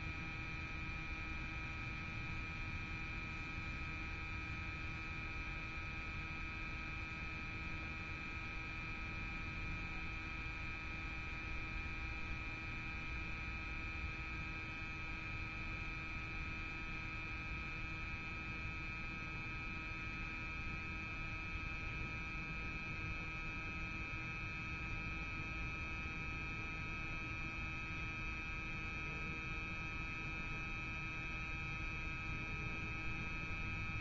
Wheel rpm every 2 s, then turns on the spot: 0, 0, 0, 0, 0, 0, 0, 0, 0, 0, 0, 0, 0, 0, 0, 0, 0.
none